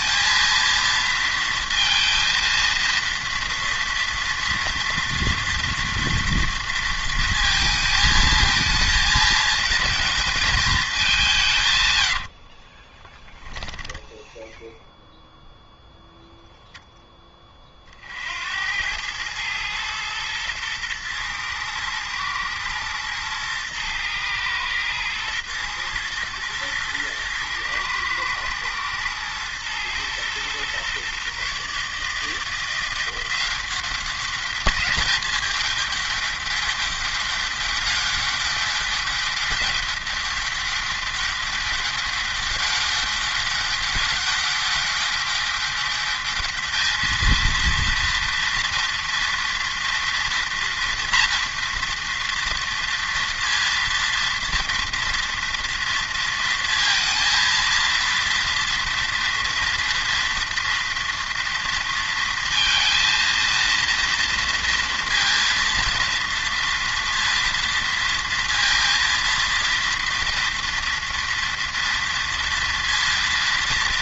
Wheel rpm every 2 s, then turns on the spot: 230, 230, 230, 230, 220, 220, 40, 0, 0, 80, 110, 110, 110, 110, 110, 120, 160, 200, 200, 200, 200, 200, 200, 210, 230, 230, 230, 230, 230, 230, 230, 230, 230, 230, 230, 230, 230.
12-14